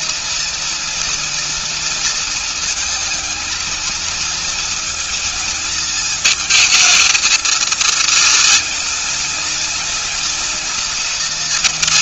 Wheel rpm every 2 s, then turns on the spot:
220, 220, 220, 230, 240, 220.
none